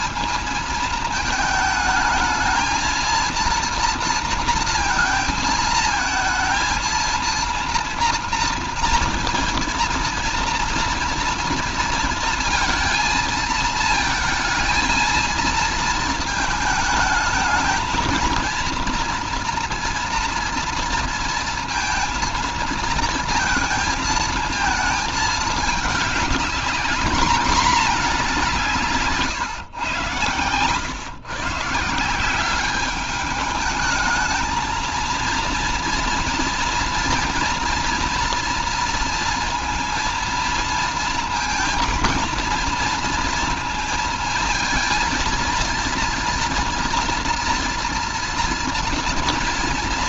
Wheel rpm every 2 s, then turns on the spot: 220, 220, 230, 230, 240, 230, 230, 230, 220, 230, 230, 230, 220, 210, 180, 120, 190, 220, 230, 230, 230, 230, 230, 230, 230.
none